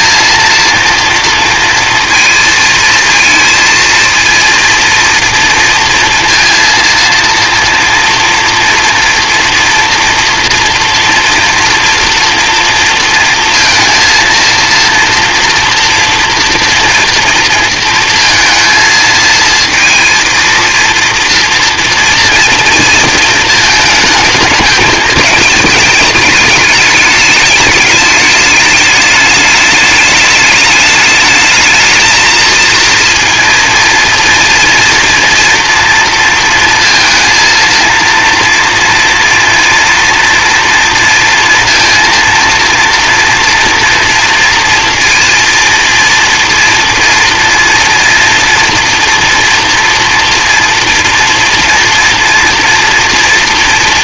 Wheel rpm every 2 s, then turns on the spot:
230, 230, 230, 230, 230, 240, 230, 230, 230, 220, 230, 230, 220, 210, 210, 210, 230, 230, 230, 230, 230, 230, 230, 230, 230, 230, 230.
none